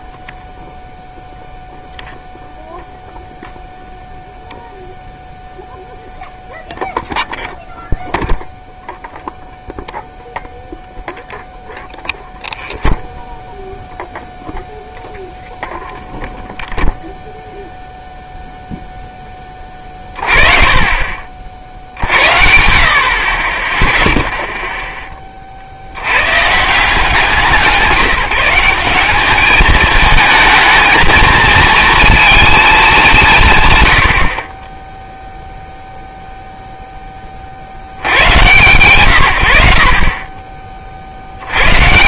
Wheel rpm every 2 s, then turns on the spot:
0, 0, 0, 0, 0, 0, 0, 0, 0, 0, 40, 40, 0, 150, 190, 220, 210, 10, 0, 110, 40.
none